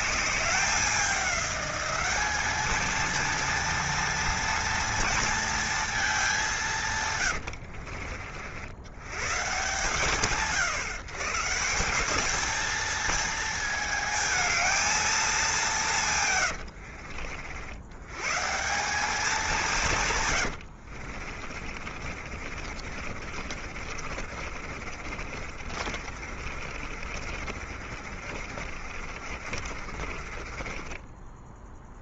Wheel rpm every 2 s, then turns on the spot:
200, 220, 230, 170, 90, 130, 220, 220, 90, 180, 90, 40, 60, 50, 50, 30.
16-18 20-32